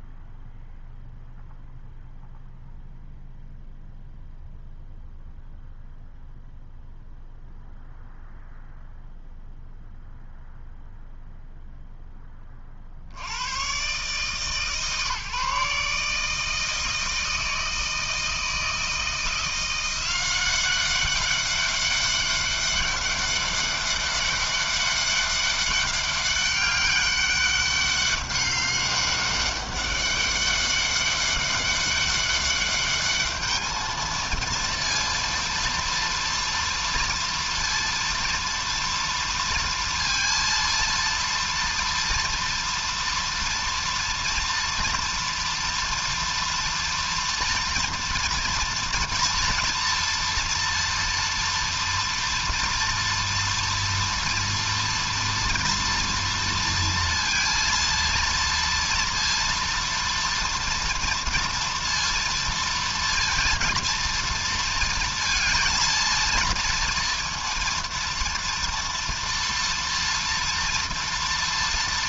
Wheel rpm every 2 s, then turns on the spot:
0, 0, 0, 0, 0, 0, 30, 140, 160, 160, 190, 200, 200, 200, 200, 200, 200, 230, 230, 230, 230, 230, 230, 230, 230, 240, 230, 230, 230, 230, 230, 230, 230, 230, 230, 240.
none